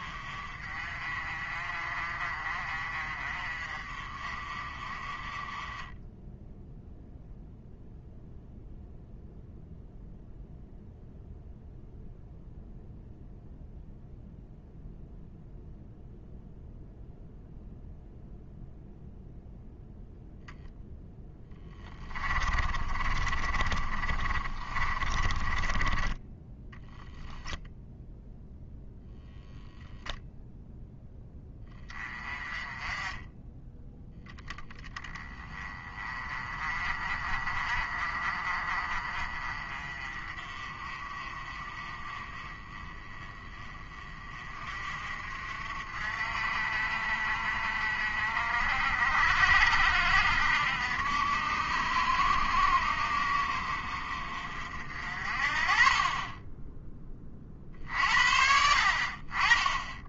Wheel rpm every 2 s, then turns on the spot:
40, 40, 40, 0, 0, 0, 0, 0, 0, 0, 0, 20, 20, 10, 0, 0, 20, 20, 30, 30, 40, 30, 40, 50, 50, 60, 60, 50, 10, 50.
22-26